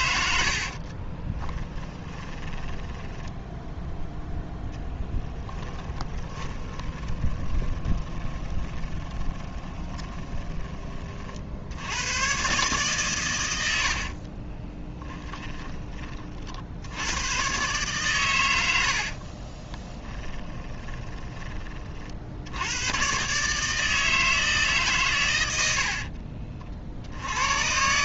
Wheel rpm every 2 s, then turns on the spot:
40, 20, 10, 20, 20, 30, 140, 20, 90, 70, 20, 110, 140, 50.
0-4 6-10 14-16 20-22